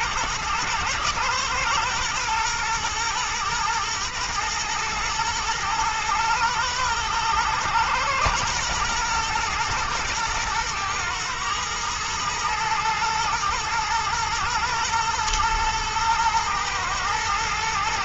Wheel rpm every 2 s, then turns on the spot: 110, 120, 110, 110, 110, 120, 120, 120, 120.
none